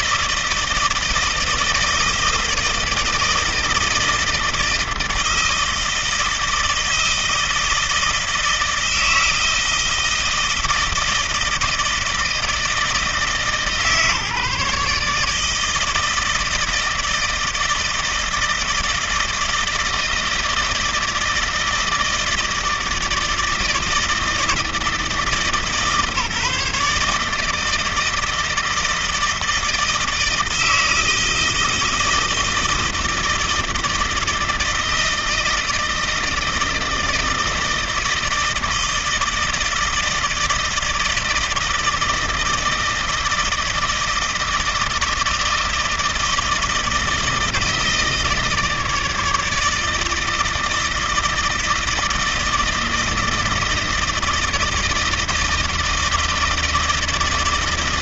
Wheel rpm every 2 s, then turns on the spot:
160, 160, 160, 160, 160, 160, 160, 150, 160, 160, 160, 160, 160, 150, 160, 160, 160, 160, 160, 160, 160, 160, 160, 160, 160, 160, 160, 160, 160.
none